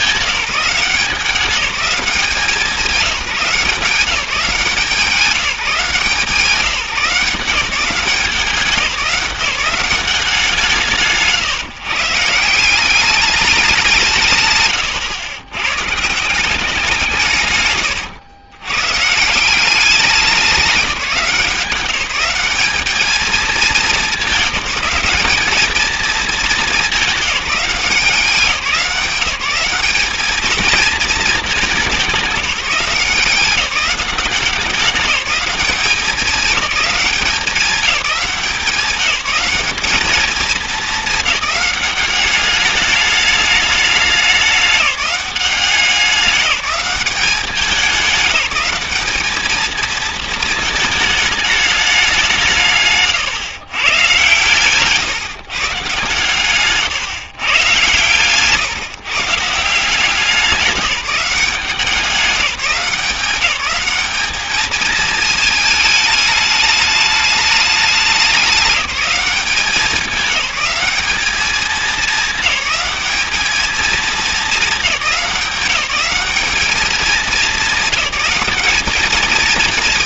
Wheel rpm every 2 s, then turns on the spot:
190, 180, 170, 170, 190, 160, 170, 120, 180, 100, 200, 210, 200, 210, 180, 220, 180, 190, 200, 190, 210, 210, 200, 190, 200, 220, 160, 140, 140, 130, 180, 190, 220, 210, 200, 200, 210, 210, 210, 210.
56-58